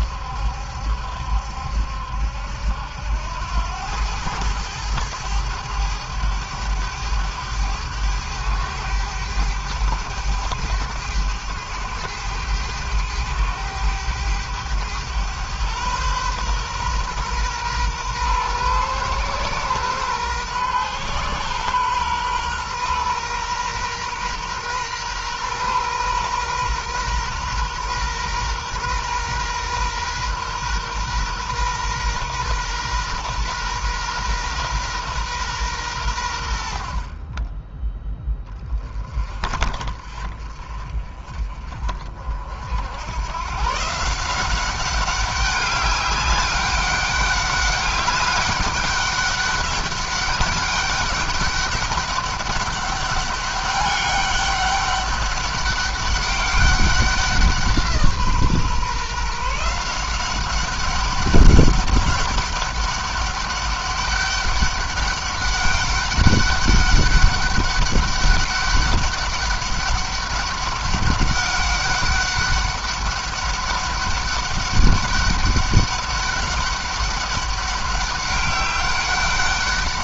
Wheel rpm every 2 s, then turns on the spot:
70, 80, 110, 100, 100, 100, 100, 110, 120, 120, 120, 120, 120, 120, 120, 120, 130, 120, 50, 30, 40, 90, 190, 200, 200, 200, 200, 200, 190, 150, 190, 200, 200, 200, 200, 200, 200, 200, 200, 200.
none